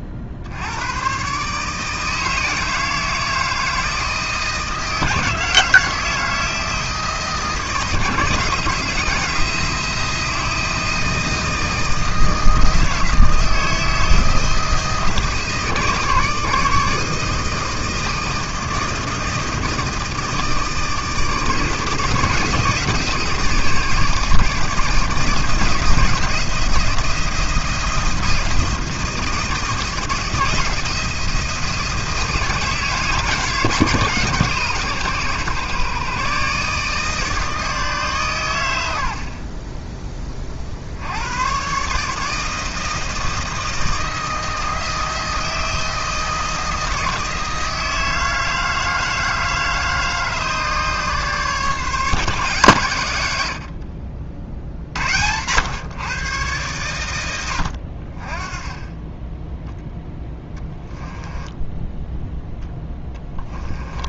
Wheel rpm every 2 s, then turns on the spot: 90, 160, 160, 160, 160, 160, 160, 160, 150, 160, 160, 160, 160, 170, 170, 170, 160, 140, 140, 110, 40, 160, 160, 160, 160, 150, 140, 70, 120, 20, 20, 0.
60-62